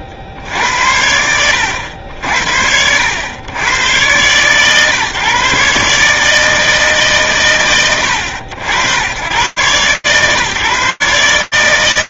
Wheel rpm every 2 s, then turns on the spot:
80, 110, 150, 60, 120, 160.
none